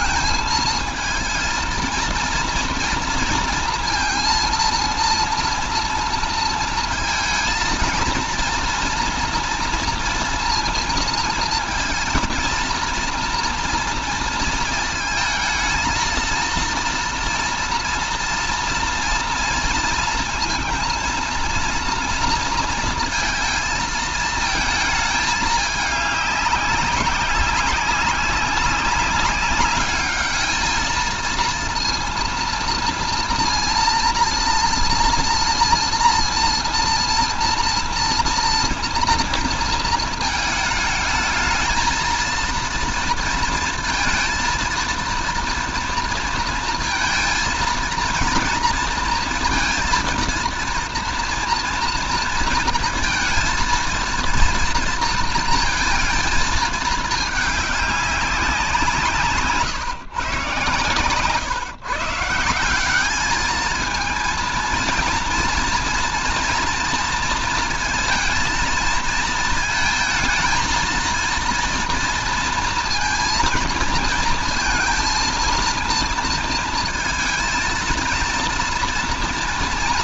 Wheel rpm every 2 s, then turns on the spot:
220, 230, 230, 230, 230, 230, 230, 230, 230, 230, 230, 230, 220, 200, 190, 210, 230, 230, 230, 230, 220, 230, 230, 230, 230, 230, 230, 230, 220, 190, 130, 170, 230, 230, 230, 220, 230, 230, 230, 240.
none